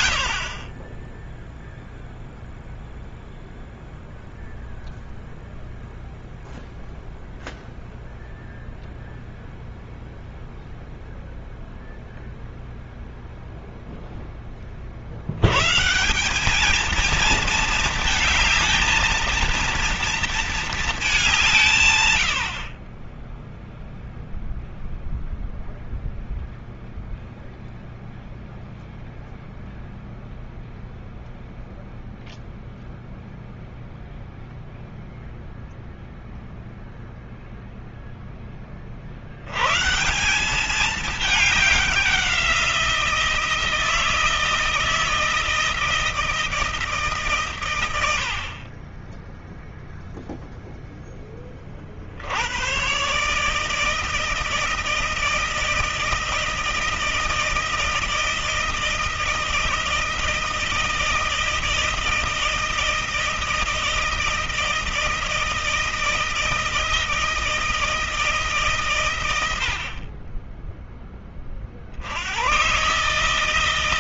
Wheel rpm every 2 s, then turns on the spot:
40, 0, 0, 0, 0, 0, 0, 40, 210, 220, 210, 30, 0, 0, 0, 0, 0, 0, 0, 30, 200, 170, 160, 150, 30, 0, 110, 160, 160, 160, 160, 160, 160, 160, 130, 10, 130.
none